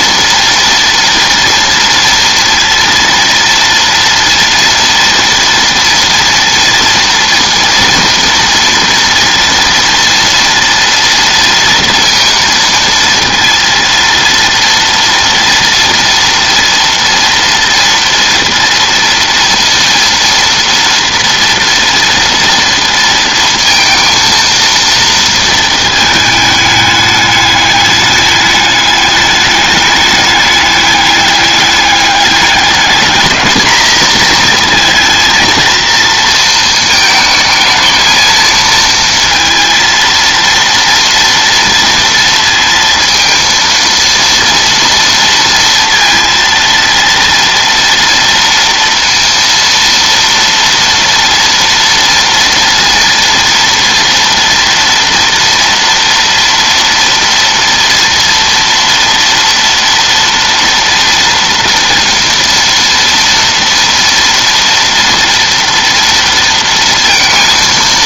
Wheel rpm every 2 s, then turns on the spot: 230, 230, 230, 230, 230, 230, 230, 230, 230, 230, 230, 230, 230, 210, 200, 200, 210, 230, 220, 230, 230, 230, 230, 230, 230, 230, 230, 230, 230, 230, 230, 230, 230, 230.
none